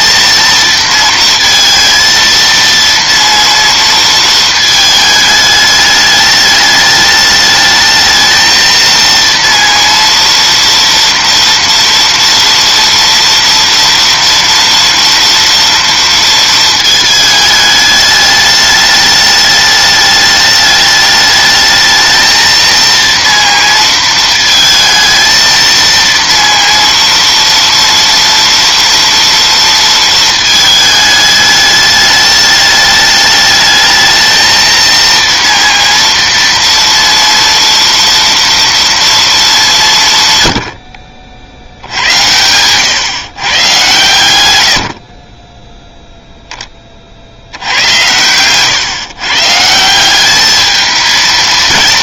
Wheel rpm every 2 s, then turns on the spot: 230, 230, 220, 210, 220, 230, 230, 230, 220, 210, 210, 230, 220, 230, 230, 220, 210, 220, 230, 230, 90, 110, 90, 10, 120, 210.
none